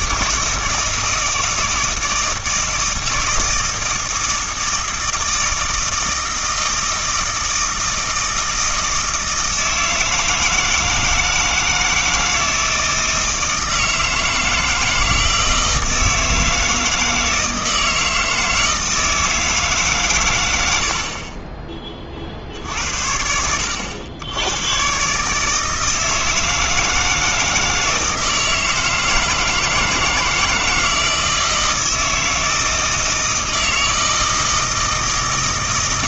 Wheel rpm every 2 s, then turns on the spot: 160, 160, 160, 160, 160, 160, 160, 160, 160, 160, 90, 60, 110, 160, 160, 160, 160, 160.
none